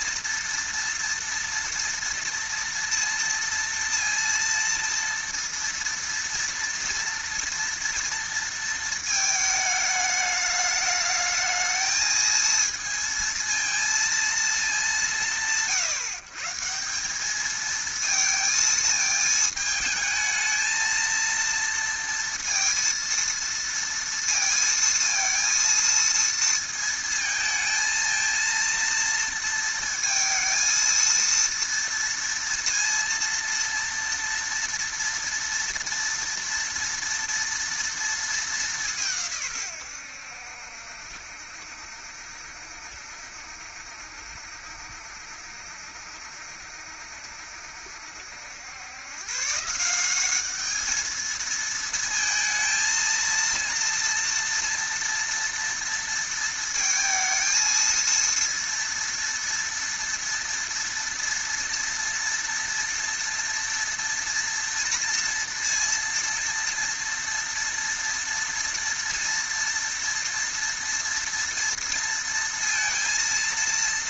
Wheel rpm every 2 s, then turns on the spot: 230, 230, 230, 230, 230, 210, 230, 190, 160, 220, 220, 230, 230, 230, 230, 230, 230, 230, 230, 190, 70, 70, 70, 70, 90, 210, 230, 230, 230, 230, 230, 230, 230, 240, 230, 240, 230.
none